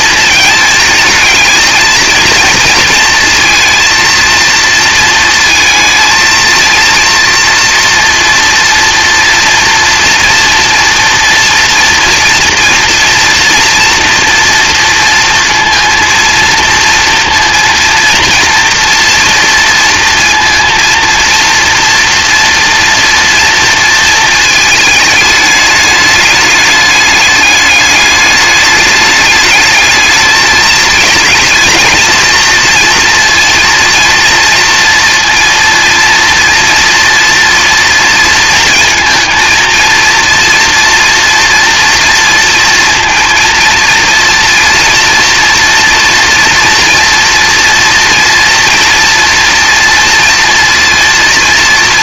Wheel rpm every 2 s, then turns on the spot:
220, 230, 230, 230, 230, 230, 240, 230, 230, 230, 230, 240, 220, 210, 210, 220, 230, 230, 230, 230, 230, 230, 230, 240, 230, 230.
none